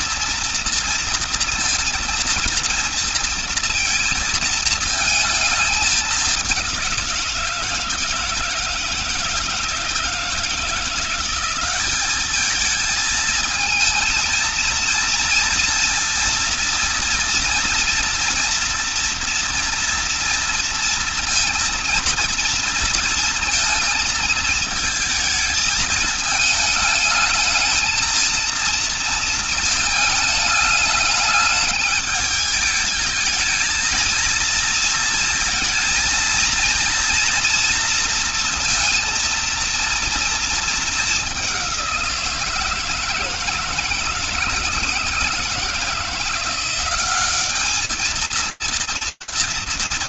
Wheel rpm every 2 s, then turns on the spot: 230, 230, 220, 170, 160, 180, 220, 230, 230, 240, 230, 230, 220, 220, 230, 210, 220, 230, 230, 230, 210, 160, 160, 190, 230.
none